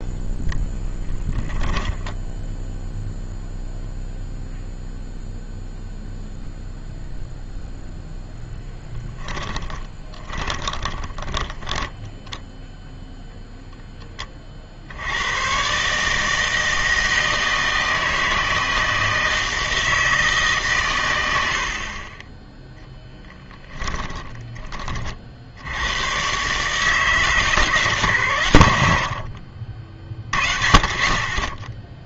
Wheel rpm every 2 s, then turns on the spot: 10, 0, 0, 0, 10, 10, 0, 40, 160, 160, 140, 10, 20, 140, 100, 20.
0-2 10-12